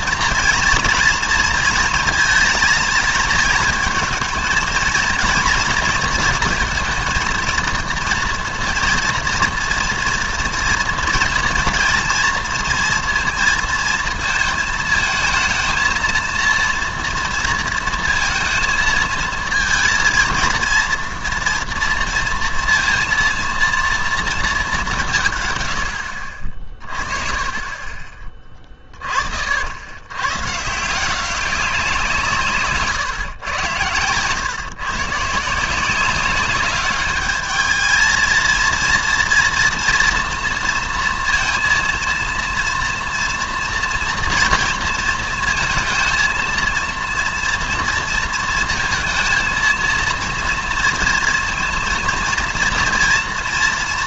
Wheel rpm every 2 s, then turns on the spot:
230, 230, 230, 230, 230, 230, 230, 220, 230, 230, 230, 230, 200, 40, 20, 150, 140, 130, 200, 230, 230, 230, 230, 230, 230, 230, 230.
32-34